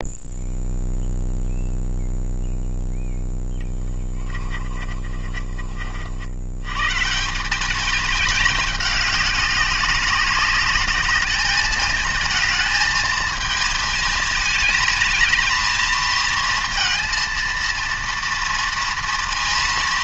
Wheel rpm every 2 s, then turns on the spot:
0, 0, 30, 140, 200, 210, 220, 220, 230, 230.
4-6